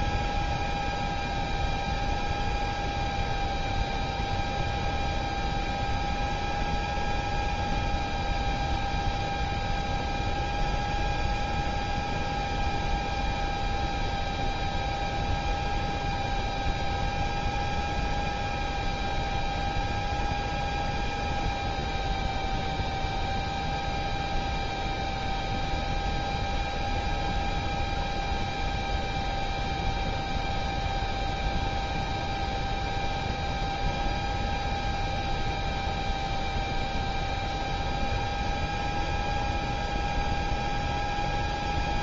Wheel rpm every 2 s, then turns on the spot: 0, 0, 0, 0, 0, 0, 0, 0, 0, 0, 0, 0, 0, 0, 0, 0, 0, 0, 0, 0, 0.
none